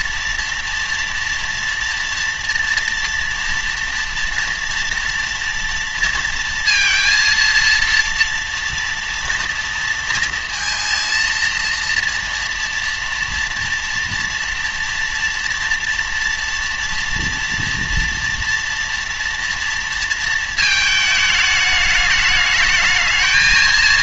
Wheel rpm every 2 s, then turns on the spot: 230, 230, 230, 230, 230, 230, 230, 230, 230, 230, 220, 210.
none